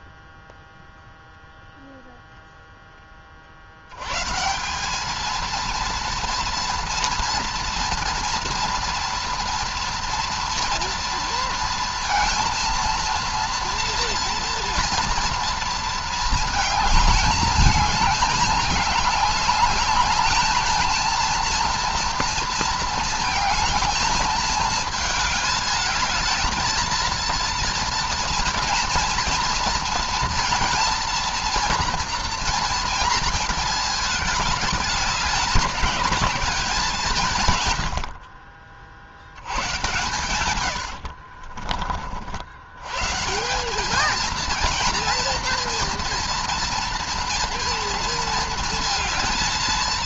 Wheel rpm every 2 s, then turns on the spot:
0, 0, 170, 230, 230, 230, 230, 240, 220, 210, 220, 220, 220, 220, 230, 230, 230, 210, 190, 50, 100, 90, 230, 230, 230.
40-42